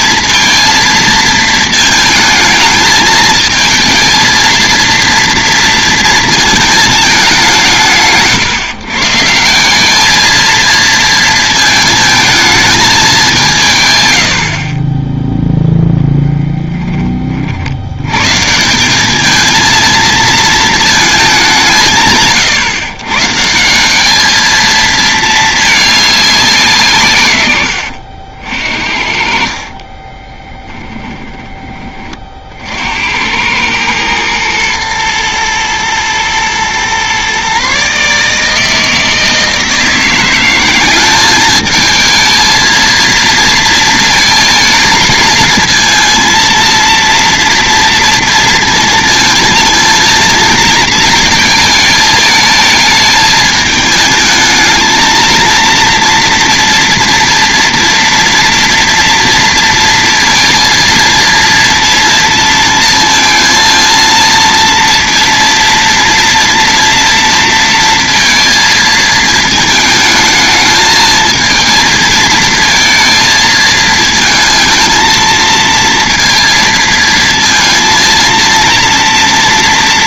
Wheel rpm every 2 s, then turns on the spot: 220, 210, 230, 220, 150, 220, 220, 50, 10, 160, 220, 130, 220, 170, 60, 10, 60, 120, 120, 160, 190, 220, 220, 230, 230, 230, 220, 220, 230, 230, 230, 230, 230, 230, 220, 220, 230, 220, 230, 230.
14-16 30-32